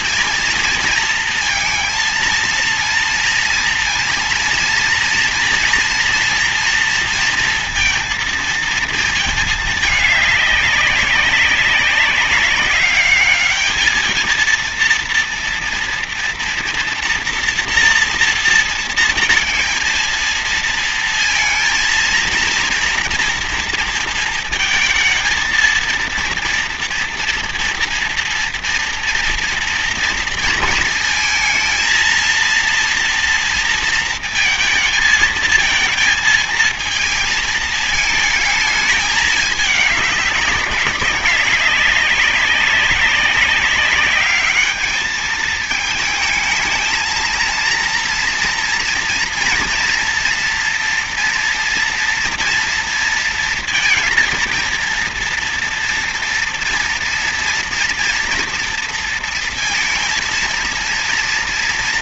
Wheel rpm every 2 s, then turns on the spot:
230, 230, 230, 230, 230, 200, 200, 230, 230, 230, 230, 230, 220, 230, 230, 220, 230, 220, 220, 220, 200, 200, 210, 220, 230, 230, 230, 230, 230, 230, 230.
none